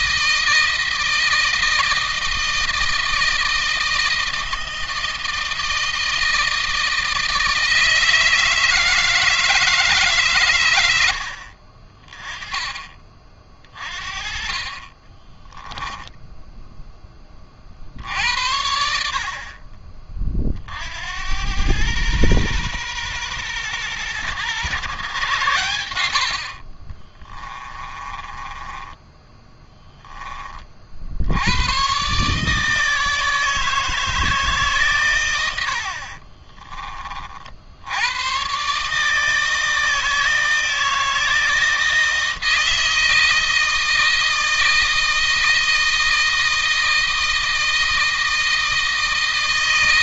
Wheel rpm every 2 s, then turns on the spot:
160, 160, 160, 160, 160, 100, 30, 20, 10, 60, 60, 120, 120, 40, 20, 60, 150, 130, 30, 140, 160, 160, 160, 160, 160.
14-16 26-30